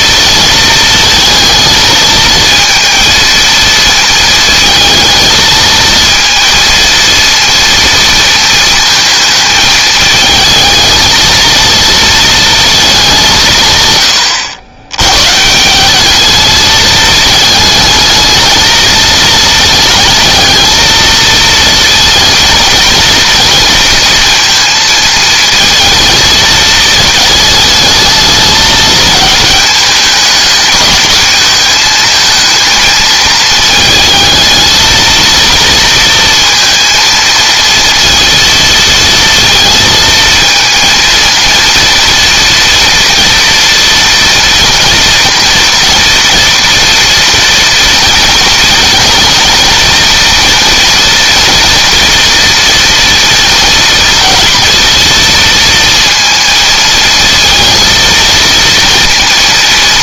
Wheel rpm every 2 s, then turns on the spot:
230, 230, 220, 230, 220, 220, 210, 110, 220, 220, 220, 230, 220, 220, 220, 210, 220, 230, 230, 230, 230, 230, 230, 230, 230, 230, 230, 230, 220, 230.
none